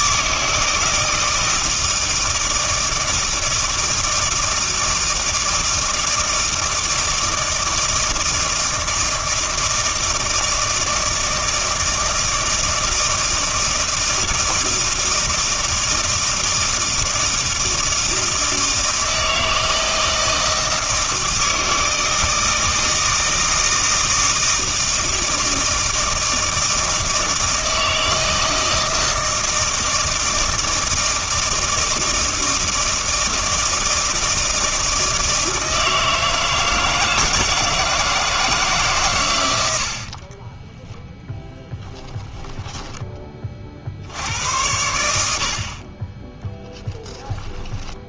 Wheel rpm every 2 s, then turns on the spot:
160, 160, 160, 160, 160, 160, 160, 160, 160, 160, 160, 160, 160, 160, 160, 160, 160, 160, 160, 150, 10, 10, 90, 0.
40-42